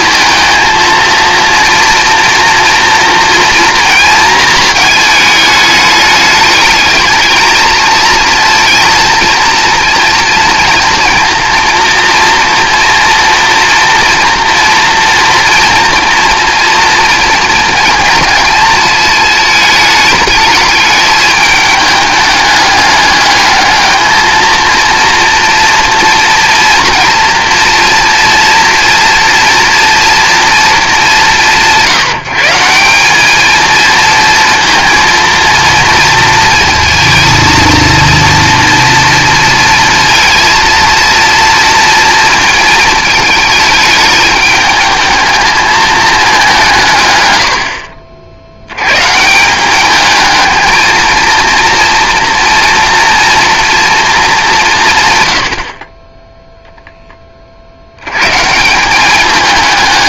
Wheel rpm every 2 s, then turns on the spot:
230, 230, 220, 210, 230, 230, 240, 230, 230, 230, 210, 210, 230, 230, 230, 230, 170, 230, 230, 230, 230, 220, 210, 180, 100, 220, 240, 180, 0, 160.
none